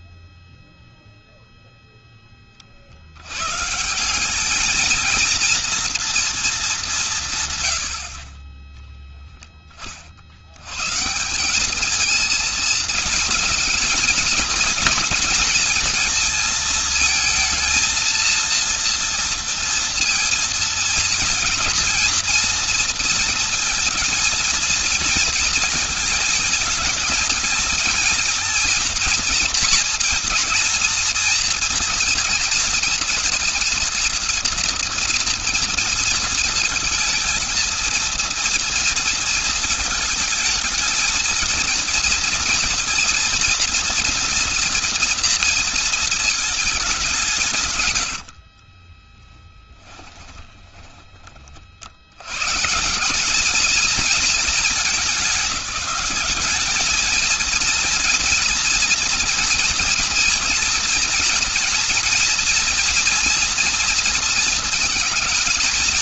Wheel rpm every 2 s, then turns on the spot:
0, 20, 200, 230, 40, 90, 220, 230, 230, 230, 230, 220, 220, 230, 230, 230, 230, 230, 230, 230, 220, 230, 240, 220, 60, 20, 120, 220, 210, 230, 230, 230, 220.
48-52